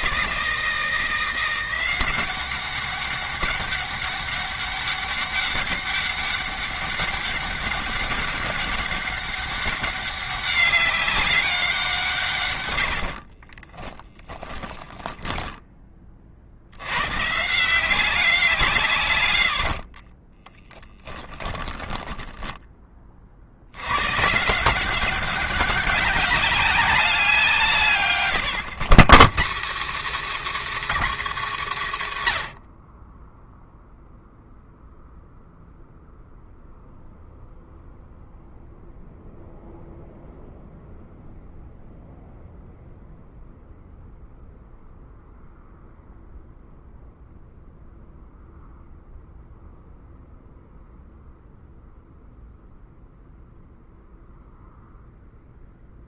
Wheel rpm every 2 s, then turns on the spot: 170, 200, 200, 200, 200, 200, 70, 10, 130, 120, 20, 30, 180, 190, 150, 240, 30, 0, 0, 0, 0, 0, 0, 0, 0, 0, 0, 0.
12-16 20-22